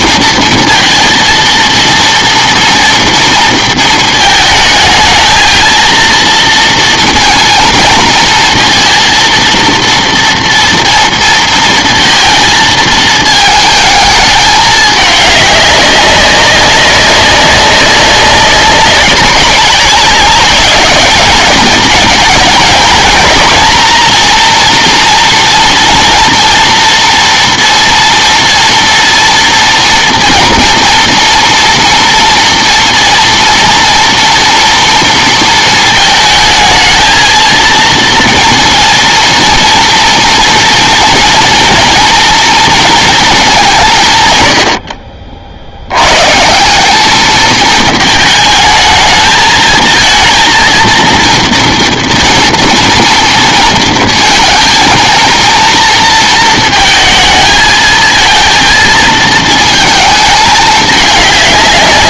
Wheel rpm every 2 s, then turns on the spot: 230, 230, 220, 230, 230, 230, 220, 210, 200, 190, 200, 230, 240, 230, 230, 230, 230, 230, 220, 230, 240, 240, 80, 170, 220, 230, 230, 230, 230, 220, 210.
none